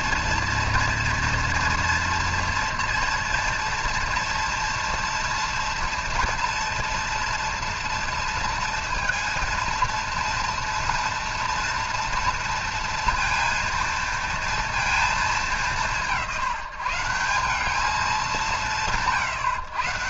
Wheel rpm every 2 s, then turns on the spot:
230, 230, 230, 230, 230, 230, 230, 220, 160, 170.
none